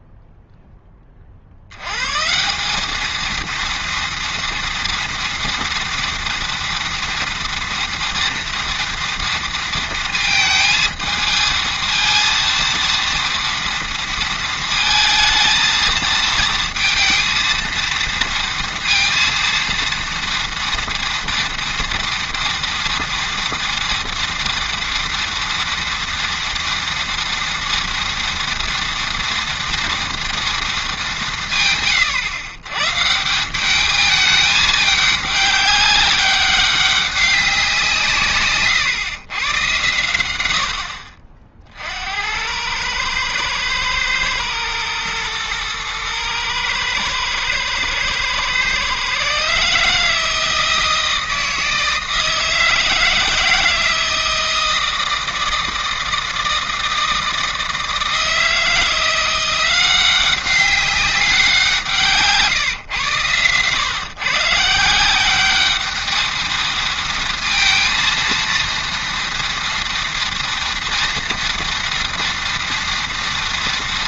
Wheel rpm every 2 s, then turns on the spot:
10, 190, 230, 230, 230, 220, 230, 220, 230, 230, 230, 230, 230, 230, 240, 220, 130, 210, 200, 130, 80, 100, 110, 110, 130, 160, 160, 160, 160, 170, 190, 140, 150, 230, 230, 230, 230.
none